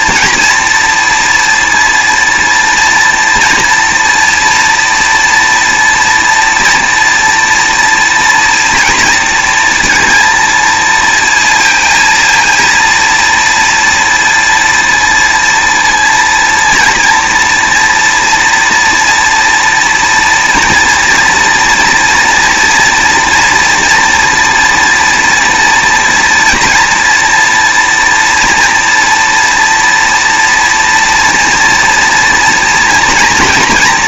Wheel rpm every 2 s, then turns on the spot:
230, 230, 230, 230, 230, 230, 230, 230, 230, 230, 230, 240, 230, 230, 230, 230, 240.
none